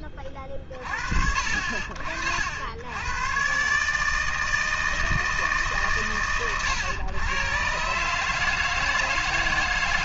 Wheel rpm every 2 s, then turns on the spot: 10, 90, 160, 110, 160.
none